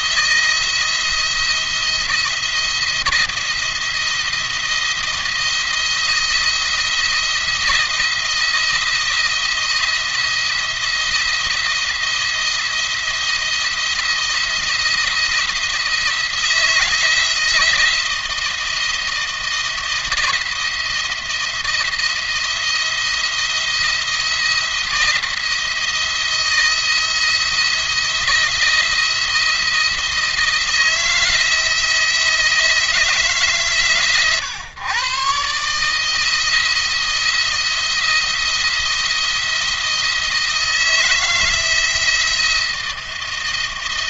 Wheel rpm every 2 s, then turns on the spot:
170, 170, 170, 170, 170, 170, 170, 170, 170, 170, 170, 170, 170, 170, 170, 160, 160, 120, 160, 170, 170, 170.
none